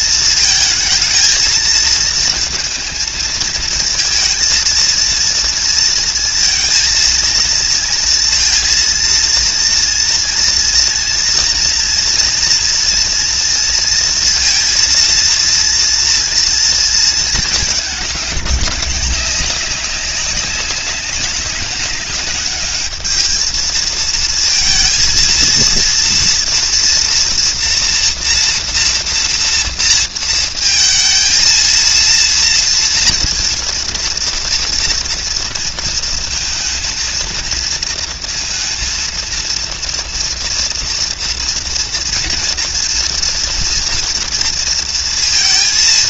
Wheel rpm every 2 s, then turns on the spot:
220, 220, 230, 230, 230, 230, 230, 230, 230, 210, 200, 210, 230, 230, 230, 230, 230, 230, 220, 230, 230, 230, 230.
none